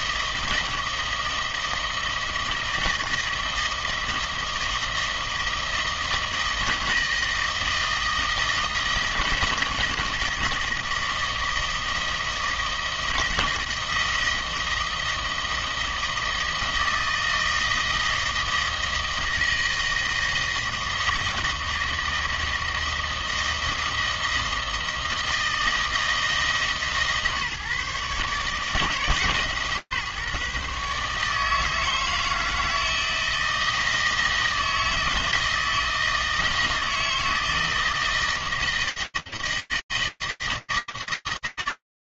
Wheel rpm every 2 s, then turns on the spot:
160, 160, 160, 160, 160, 160, 160, 160, 160, 160, 160, 160, 160, 150, 150, 150, 160, 160, 160, 160, 160.
none